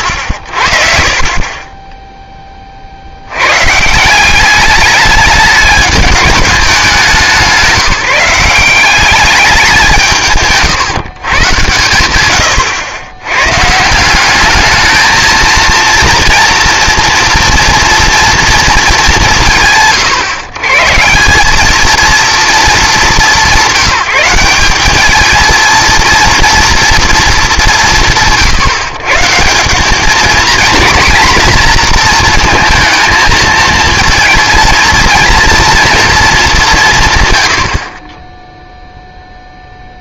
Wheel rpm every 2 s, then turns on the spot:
50, 30, 200, 200, 180, 150, 110, 210, 230, 230, 130, 200, 190, 230, 150, 230, 230, 230, 200, 0.
none